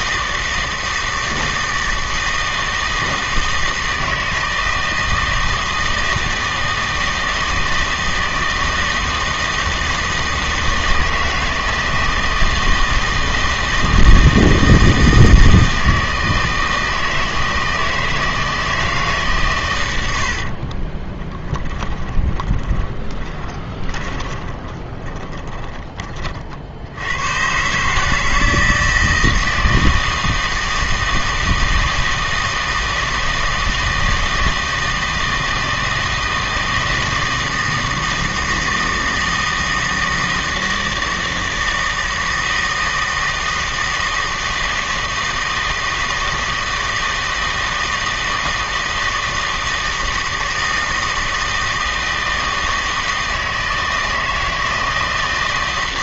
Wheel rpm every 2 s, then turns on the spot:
160, 160, 160, 160, 160, 160, 160, 160, 160, 160, 40, 20, 20, 70, 160, 160, 160, 160, 160, 160, 160, 160, 160, 160, 160, 160, 160, 160.
20-26